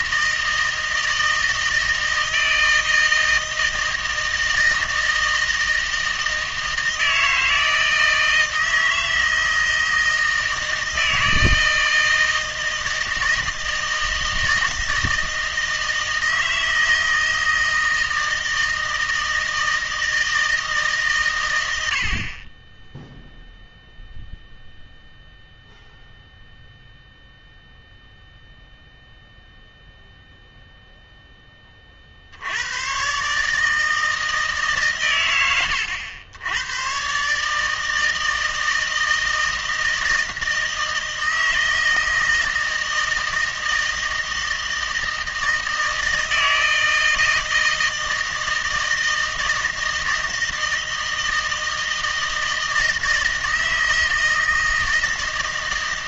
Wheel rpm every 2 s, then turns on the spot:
160, 160, 160, 160, 160, 160, 160, 160, 160, 160, 160, 10, 0, 0, 0, 0, 100, 140, 110, 160, 160, 160, 160, 160, 160, 160, 160, 160.
none